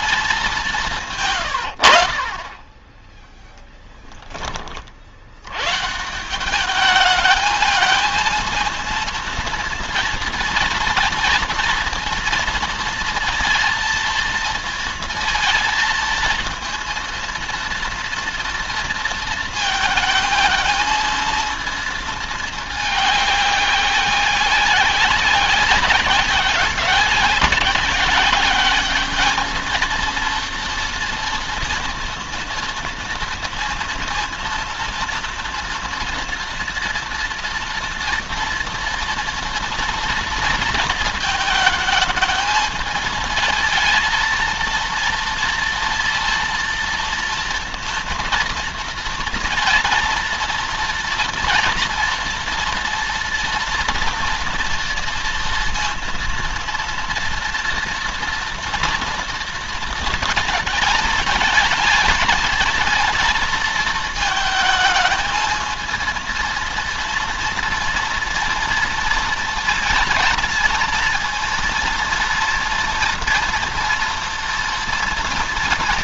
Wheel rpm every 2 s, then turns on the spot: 180, 20, 40, 200, 230, 230, 230, 230, 230, 230, 220, 220, 190, 190, 200, 230, 230, 230, 240, 230, 230, 220, 230, 240, 240, 230, 230, 230, 230, 230, 230, 220, 220, 230, 230, 230, 230, 230.
2-4